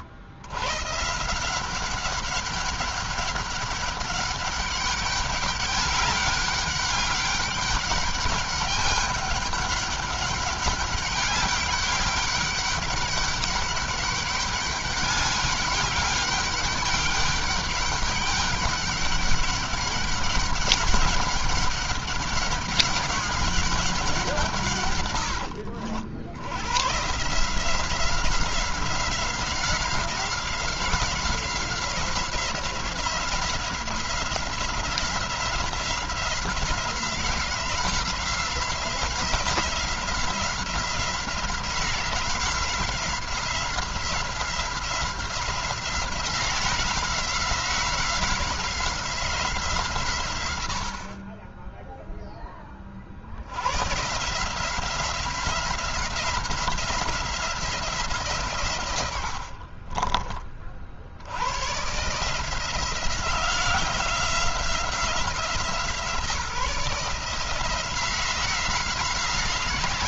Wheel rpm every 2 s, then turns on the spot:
120, 200, 200, 200, 200, 200, 200, 200, 200, 200, 200, 200, 130, 120, 180, 180, 180, 180, 180, 180, 180, 180, 180, 180, 180, 90, 30, 170, 180, 120, 50, 170, 180, 160, 180.
none